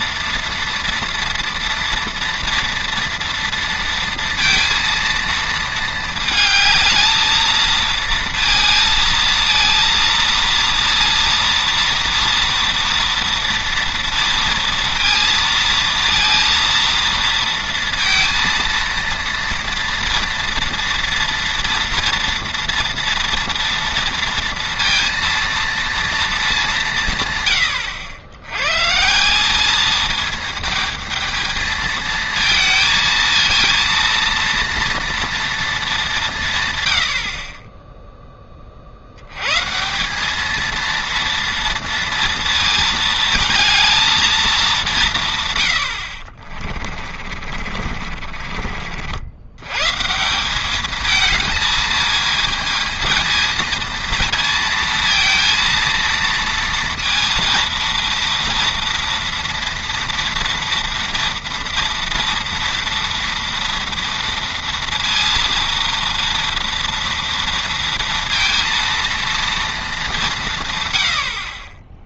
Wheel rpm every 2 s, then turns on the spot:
230, 230, 230, 220, 230, 230, 230, 230, 230, 230, 230, 230, 230, 200, 120, 220, 230, 230, 120, 40, 220, 230, 200, 40, 50, 200, 220, 230, 230, 230, 230, 230, 230, 230, 230, 130.
46-48